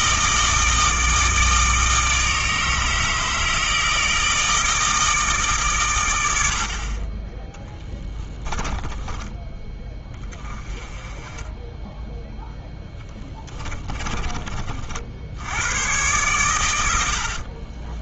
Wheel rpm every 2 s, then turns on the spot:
160, 160, 160, 40, 10, 20, 10, 50, 90.
8-10 12-14